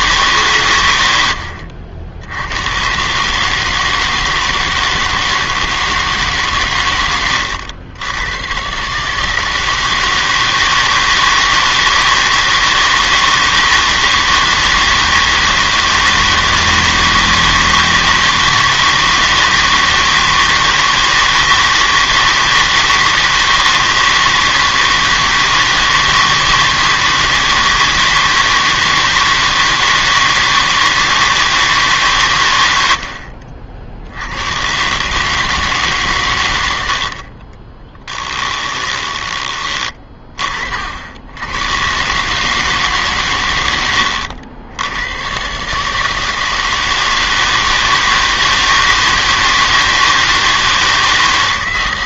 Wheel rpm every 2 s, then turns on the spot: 130, 100, 160, 120, 130, 160, 160, 160, 160, 160, 160, 160, 160, 160, 160, 160, 100, 120, 80, 10, 50, 150, 90, 160, 160, 160.
38-40